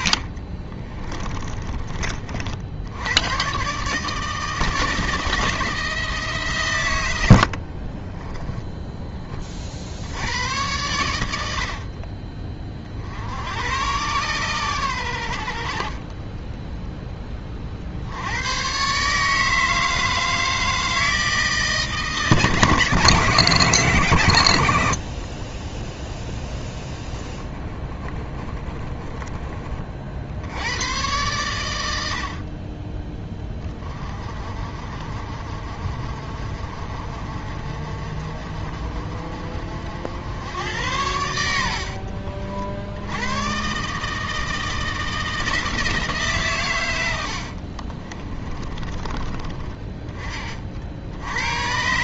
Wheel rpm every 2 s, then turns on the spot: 30, 80, 160, 110, 10, 100, 50, 100, 10, 130, 160, 150, 70, 10, 20, 100, 20, 40, 40, 40, 90, 70, 160, 100, 30, 60.
0-2 48-50